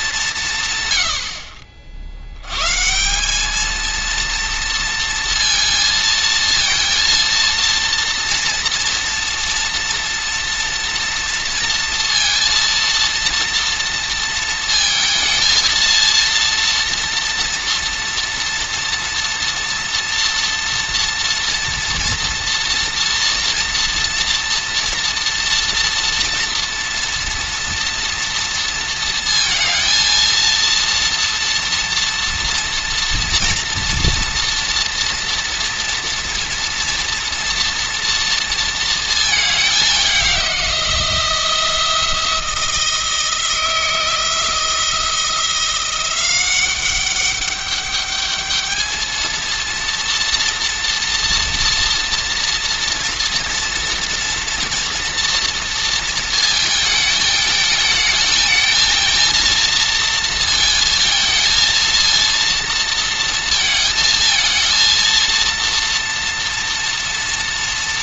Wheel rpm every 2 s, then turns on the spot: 110, 140, 230, 230, 230, 230, 230, 230, 230, 240, 240, 230, 230, 230, 230, 230, 240, 230, 230, 230, 180, 170, 160, 190, 220, 240, 230, 240, 220, 220, 230, 230, 230, 230.
none